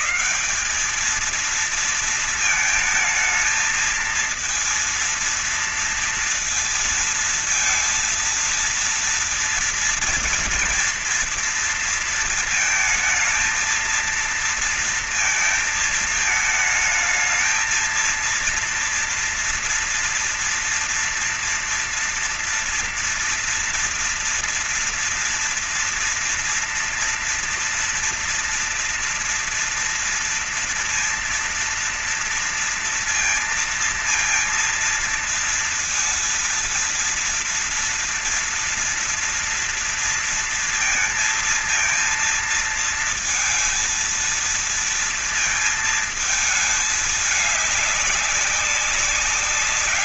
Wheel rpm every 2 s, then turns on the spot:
210, 220, 230, 230, 230, 230, 230, 230, 220, 230, 240, 230, 230, 230, 230, 230, 230, 230, 230, 230, 230, 230, 230, 220, 200.
none